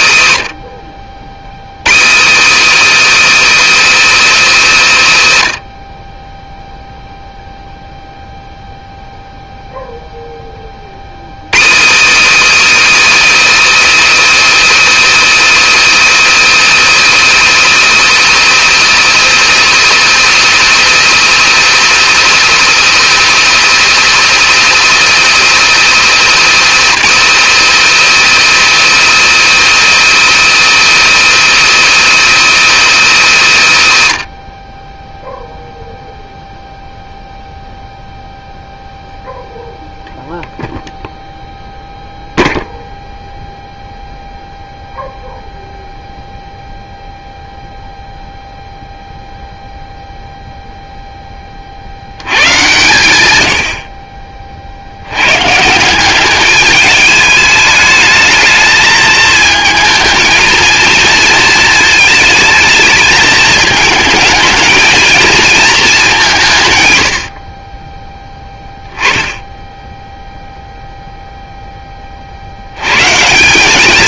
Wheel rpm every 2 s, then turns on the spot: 50, 160, 140, 0, 0, 30, 170, 170, 170, 170, 180, 170, 170, 160, 170, 170, 170, 30, 0, 0, 0, 0, 0, 0, 0, 0, 120, 60, 210, 220, 230, 220, 220, 130, 10, 0, 100.
none